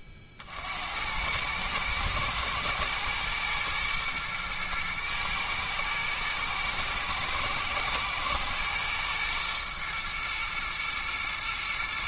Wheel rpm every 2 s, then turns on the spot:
40, 110, 110, 110, 120, 110.
none